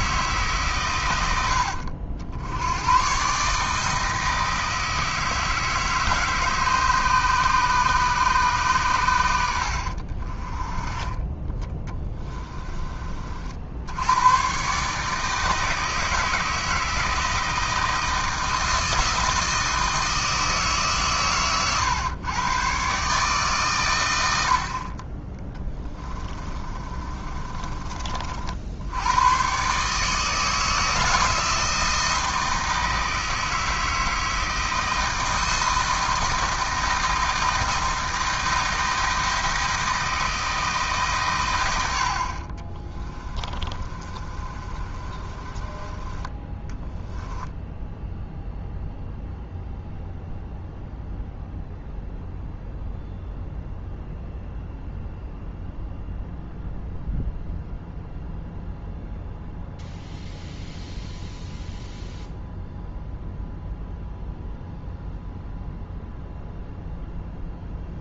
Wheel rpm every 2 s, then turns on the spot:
120, 110, 160, 150, 120, 20, 30, 140, 160, 160, 150, 140, 40, 30, 80, 160, 160, 160, 160, 160, 160, 30, 30, 10, 0, 0, 0, 0, 0, 0, 0, 0, 0, 0.
26-28 42-48